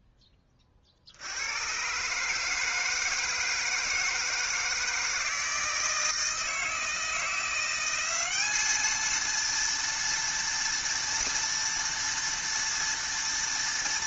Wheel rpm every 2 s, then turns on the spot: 40, 160, 160, 160, 220, 230, 230.
none